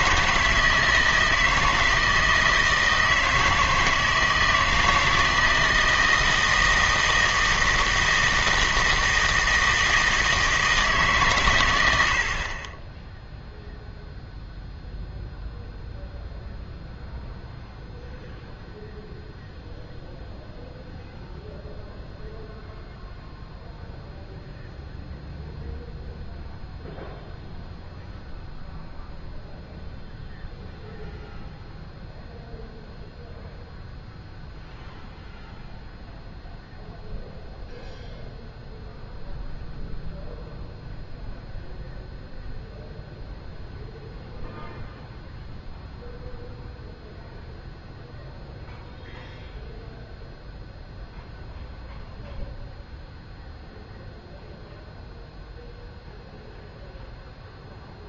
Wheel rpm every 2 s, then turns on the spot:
160, 160, 160, 160, 160, 160, 20, 0, 0, 0, 0, 0, 0, 0, 0, 0, 0, 0, 0, 0, 0, 0, 0, 0, 0, 0, 0, 0, 0.
none